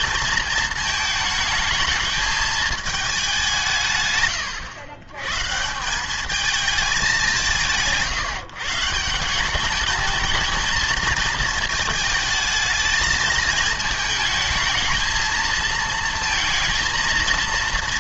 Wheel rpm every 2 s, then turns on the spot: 220, 220, 120, 220, 150, 230, 220, 220, 230.
none